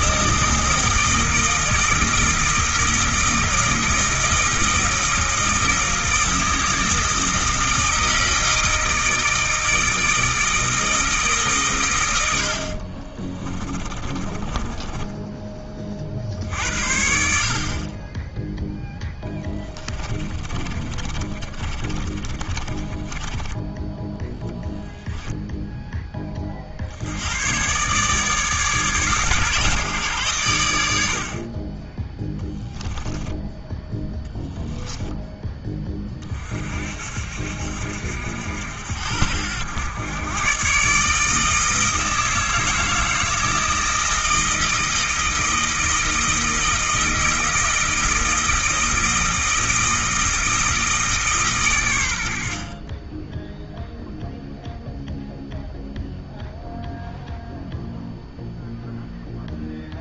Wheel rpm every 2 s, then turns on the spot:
160, 160, 160, 160, 160, 160, 50, 20, 60, 10, 30, 20, 0, 50, 140, 90, 10, 10, 50, 70, 140, 160, 160, 160, 160, 160, 50, 0, 0, 0.
12-16 18-24 32-34